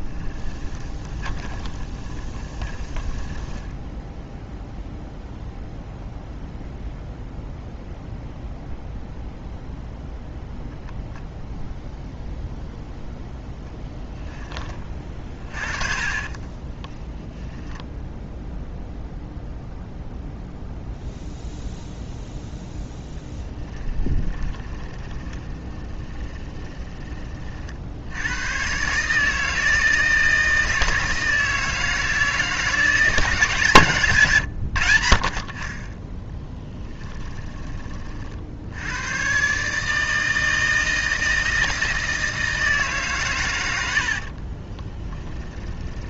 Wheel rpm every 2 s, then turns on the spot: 20, 20, 0, 0, 0, 0, 0, 20, 20, 0, 0, 0, 20, 10, 130, 160, 170, 90, 10, 80, 160, 150, 30.
0-4 16-18 24-26 36-38 44-46